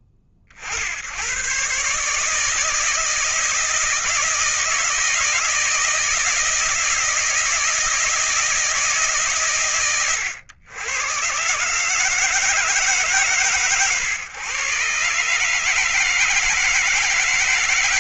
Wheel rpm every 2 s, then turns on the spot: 70, 160, 160, 160, 160, 110, 150, 120, 160.
none